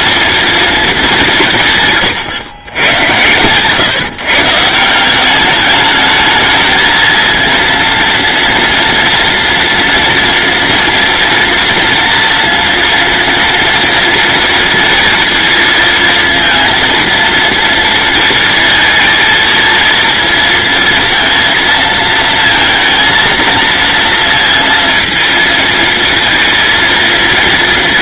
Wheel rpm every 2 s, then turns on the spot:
220, 100, 160, 220, 230, 230, 230, 230, 230, 230, 230, 230, 230, 230.
none